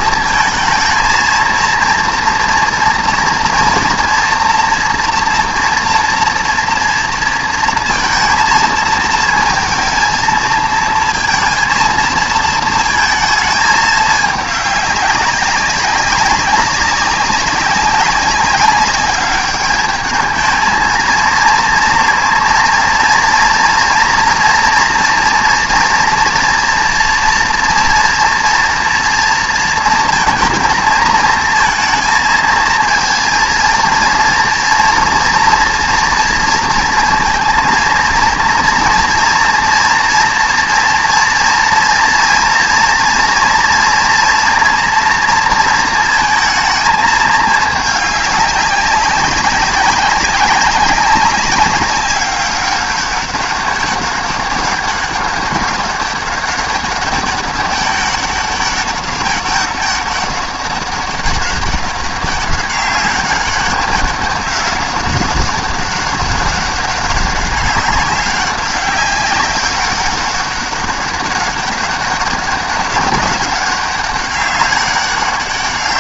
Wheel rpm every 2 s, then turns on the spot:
230, 230, 230, 230, 220, 230, 230, 200, 190, 200, 220, 230, 230, 230, 230, 230, 230, 230, 230, 230, 240, 230, 230, 220, 200, 190, 200, 200, 190, 200, 200, 200, 190, 200, 200, 200, 200, 200.
none